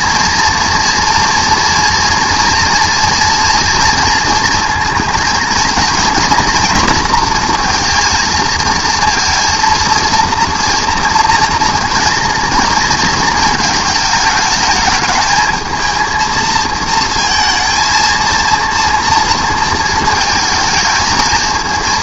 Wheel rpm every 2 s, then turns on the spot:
230, 240, 230, 230, 230, 230, 230, 220, 220, 230, 220.
none